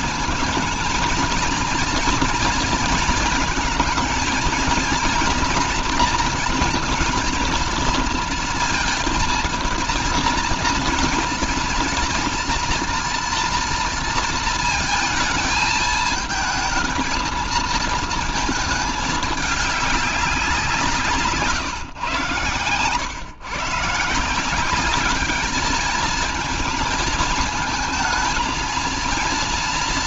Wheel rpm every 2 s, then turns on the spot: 230, 220, 230, 230, 230, 230, 240, 220, 220, 220, 170, 120, 190, 220, 230.
none